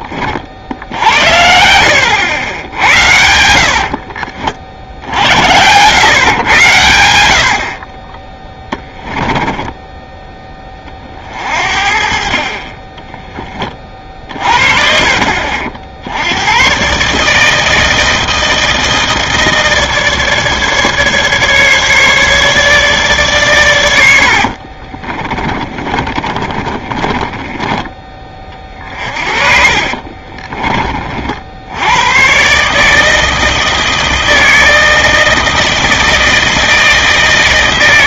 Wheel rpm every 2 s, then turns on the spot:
80, 80, 60, 90, 10, 30, 20, 40, 120, 160, 150, 150, 40, 30, 40, 30, 150, 160, 160.
2-4 24-30